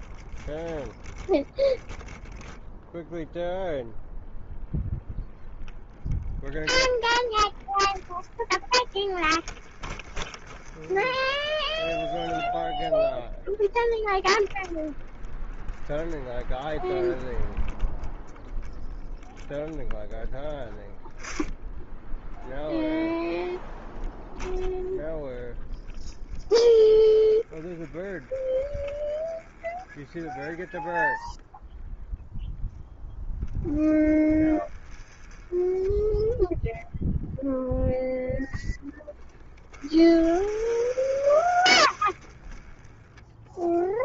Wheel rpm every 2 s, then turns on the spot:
0, 0, 0, 0, 20, 30, 10, 0, 0, 0, 10, 0, 0, 10, 20, 0, 0, 20, 0, 10, 40, 10.
8-14 26-30 34-36 38-44